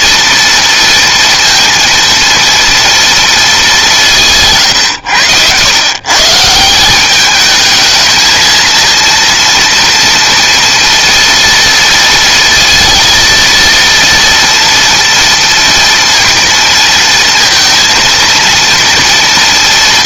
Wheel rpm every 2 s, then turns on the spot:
230, 230, 170, 150, 220, 230, 230, 230, 230, 230.
none